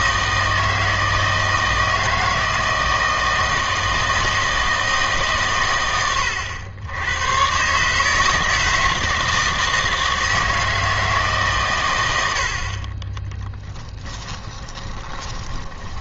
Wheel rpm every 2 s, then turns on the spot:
160, 170, 160, 90, 160, 160, 50, 20.
14-16